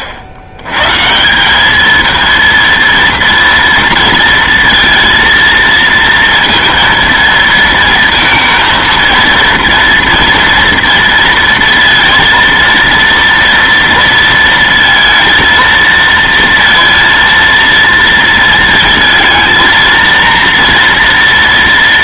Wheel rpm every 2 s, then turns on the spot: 60, 230, 230, 230, 230, 230, 230, 230, 230, 230, 230.
none